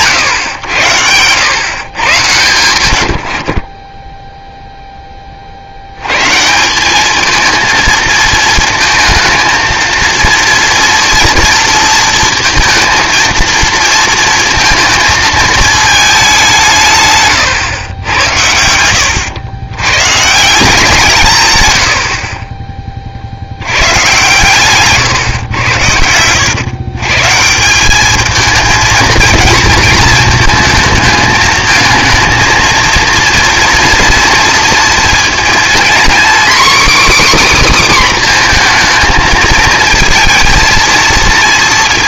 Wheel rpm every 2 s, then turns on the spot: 110, 100, 10, 180, 220, 230, 230, 230, 170, 90, 160, 30, 130, 120, 220, 220, 220, 230, 280, 240, 230.
0-2